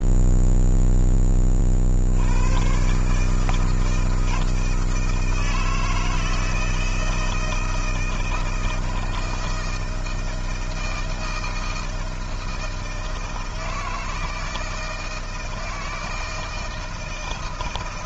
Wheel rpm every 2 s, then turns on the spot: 0, 130, 160, 160, 160, 160, 160, 160, 160.
none